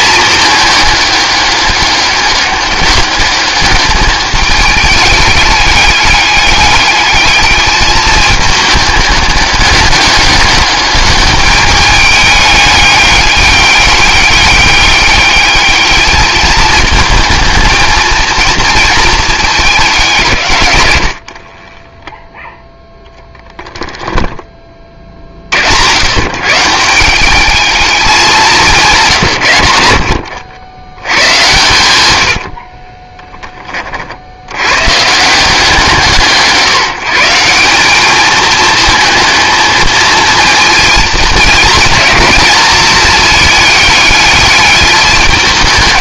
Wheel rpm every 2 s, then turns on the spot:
210, 200, 210, 210, 210, 210, 200, 200, 220, 230, 110, 0, 30, 150, 170, 90, 40, 110, 160, 220, 220, 220, 210.
32-34